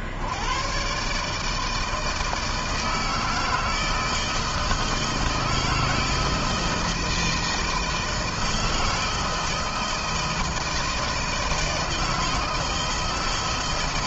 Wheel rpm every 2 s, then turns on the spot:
80, 160, 160, 160, 160, 160, 160.
none